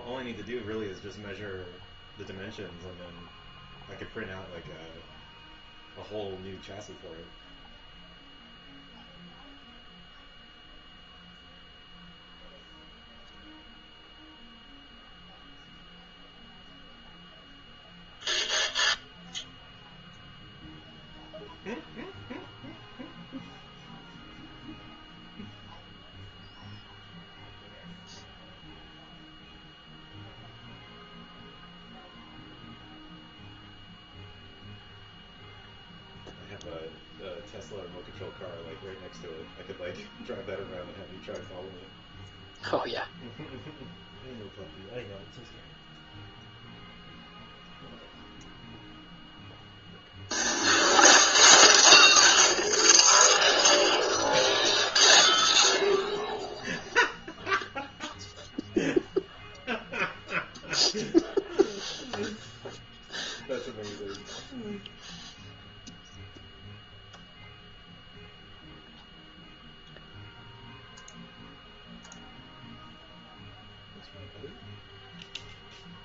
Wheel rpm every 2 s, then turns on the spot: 0, 0, 0, 0, 0, 0, 0, 0, 0, 0, 0, 0, 0, 0, 0, 0, 0, 0, 0, 0, 0, 0, 0, 0, 0, 0, 0, 0, 0, 0, 0, 0, 0, 0, 0, 0, 0, 0.
none